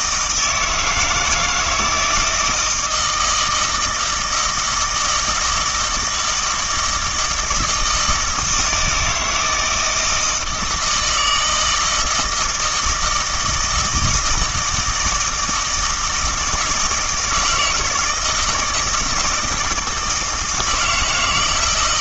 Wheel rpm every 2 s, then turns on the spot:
160, 160, 160, 160, 160, 160, 160, 160, 160, 170, 160.
none